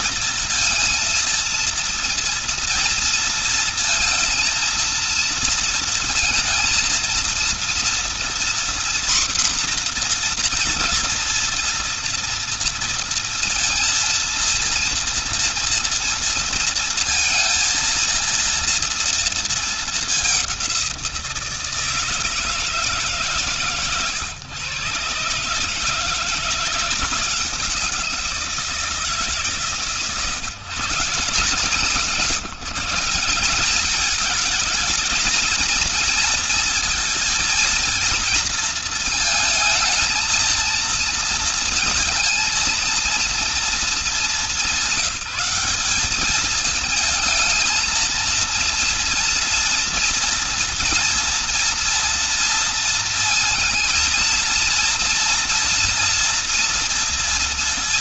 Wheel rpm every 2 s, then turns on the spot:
230, 230, 230, 230, 240, 240, 230, 230, 230, 230, 200, 160, 130, 170, 170, 150, 170, 220, 230, 230, 230, 230, 200, 210, 230, 230, 230, 230, 230.
none